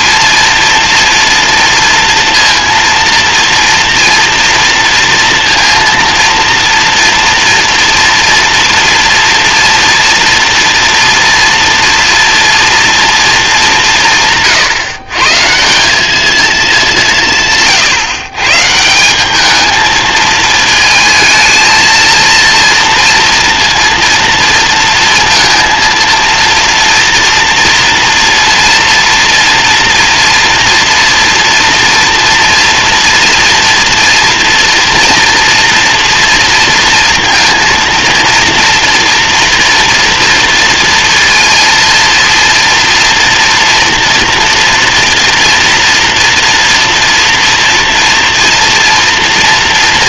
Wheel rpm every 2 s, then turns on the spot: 230, 230, 230, 230, 230, 230, 230, 130, 180, 170, 220, 230, 230, 230, 230, 240, 230, 240, 230, 230, 230, 230, 230, 230, 230.
none